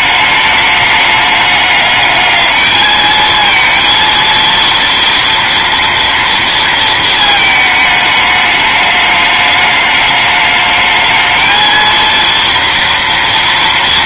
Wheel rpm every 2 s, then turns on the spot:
210, 220, 230, 220, 210, 220, 230.
none